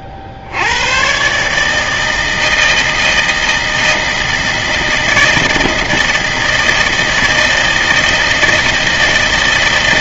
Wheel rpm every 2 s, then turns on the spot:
40, 160, 160, 160, 160.
none